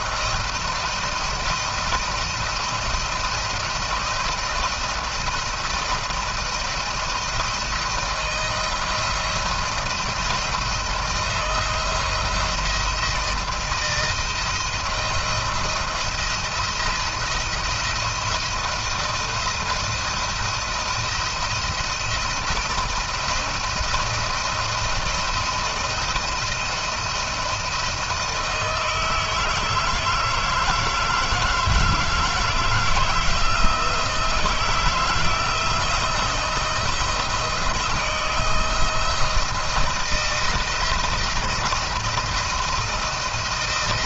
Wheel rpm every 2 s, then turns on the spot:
170, 170, 170, 170, 160, 160, 170, 170, 170, 170, 170, 170, 170, 170, 160, 160, 170, 170, 160, 160, 170, 160.
none